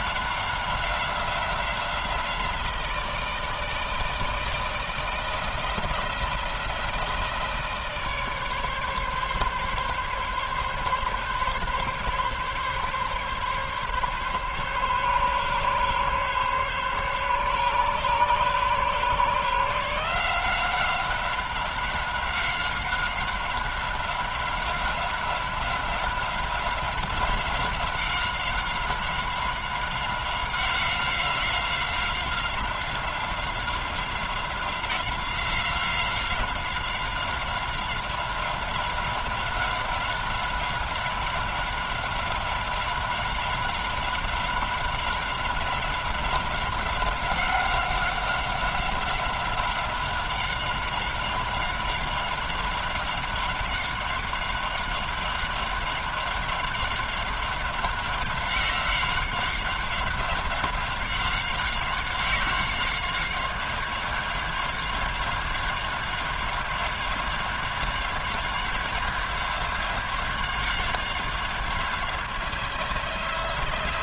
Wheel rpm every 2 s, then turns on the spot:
190, 170, 160, 170, 140, 140, 140, 140, 140, 140, 180, 190, 190, 190, 190, 190, 180, 180, 190, 190, 190, 190, 190, 190, 190, 190, 190, 190, 190, 190, 190, 190, 190, 190, 190, 190, 170.
none